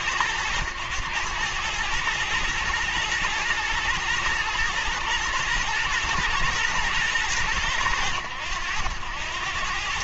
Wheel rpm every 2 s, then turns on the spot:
100, 120, 120, 110, 90.
none